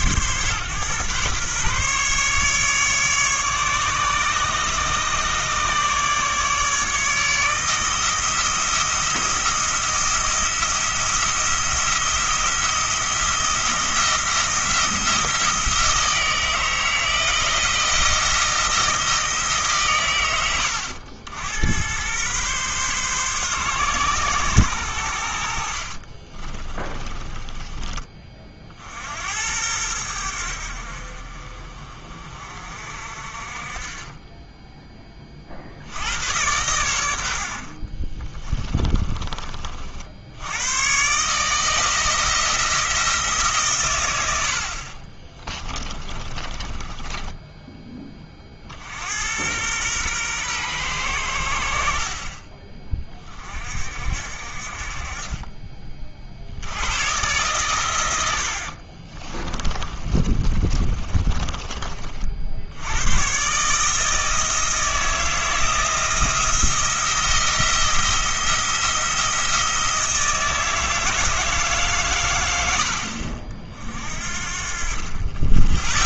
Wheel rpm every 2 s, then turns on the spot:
130, 150, 150, 150, 170, 170, 170, 170, 160, 160, 90, 130, 100, 20, 60, 60, 50, 20, 90, 20, 120, 170, 50, 10, 70, 110, 30, 50, 110, 50, 30, 90, 160, 170, 170, 160, 80, 50.
26-28 38-40 44-48 58-62